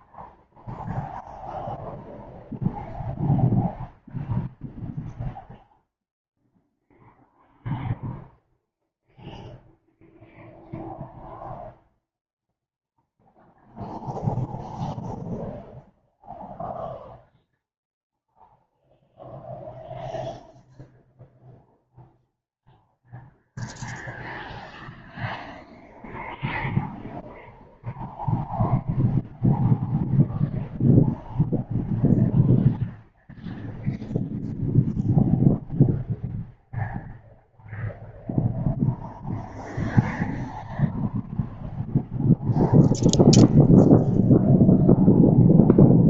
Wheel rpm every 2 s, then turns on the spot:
0, 0, 0, 0, 0, 0, 0, 0, 0, 0, 0, 0, 0, 0, 0, 0, 0, 0, 0, 0, 0, 0, 0.
none